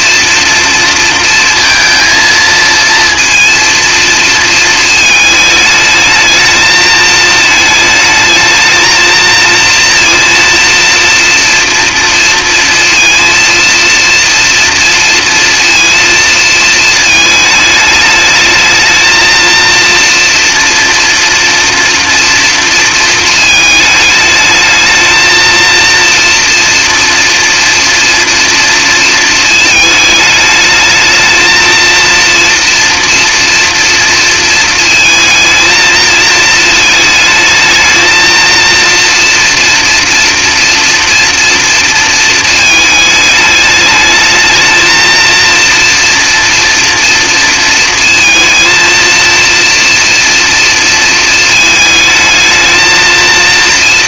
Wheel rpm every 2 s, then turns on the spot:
230, 230, 220, 220, 220, 230, 230, 230, 230, 220, 230, 230, 220, 230, 230, 210, 230, 230, 220, 230, 240, 220, 220, 230, 230, 230, 220.
none